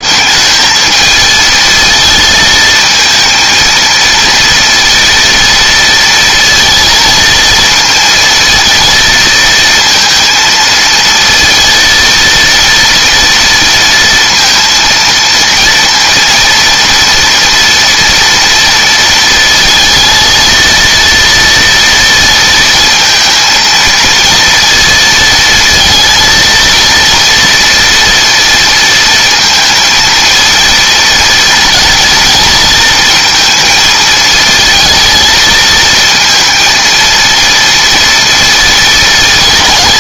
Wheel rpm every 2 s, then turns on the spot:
220, 220, 230, 230, 230, 230, 230, 230, 230, 230, 230, 230, 230, 230, 230, 230, 230, 220, 230, 220.
none